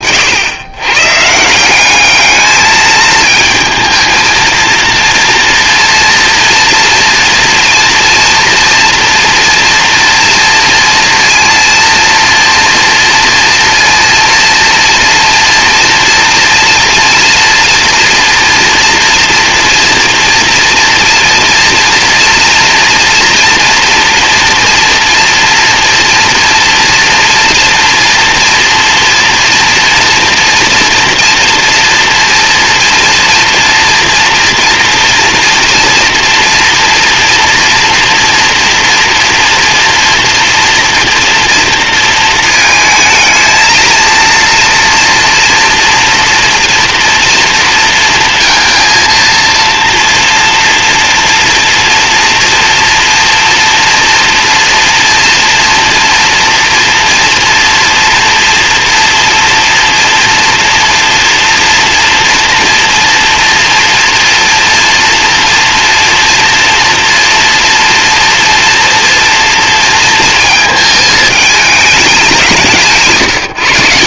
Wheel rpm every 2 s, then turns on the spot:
130, 220, 230, 240, 230, 230, 230, 230, 230, 230, 230, 230, 230, 230, 230, 230, 230, 240, 230, 230, 230, 220, 230, 230, 230, 230, 230, 230, 240, 230, 230, 230, 230, 230, 230, 220, 150.
72-74